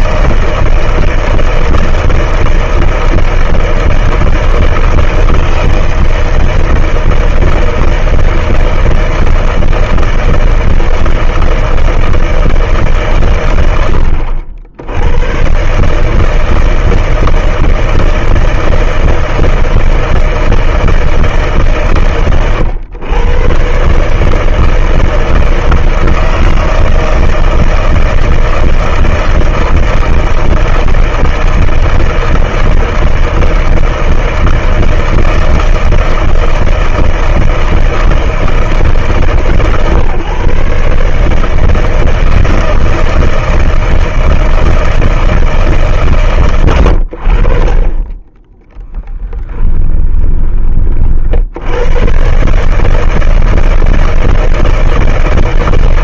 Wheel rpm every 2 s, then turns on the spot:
160, 160, 160, 160, 160, 160, 160, 120, 110, 160, 160, 150, 120, 160, 160, 160, 160, 160, 160, 160, 140, 160, 160, 160, 50, 10, 60, 160.
50-52